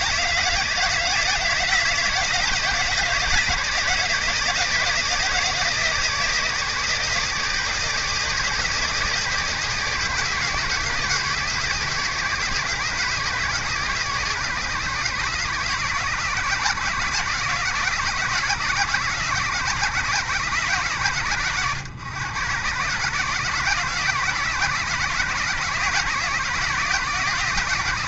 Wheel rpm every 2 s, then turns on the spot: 160, 160, 150, 140, 120, 110, 110, 100, 90, 100, 80, 80, 90, 90.
none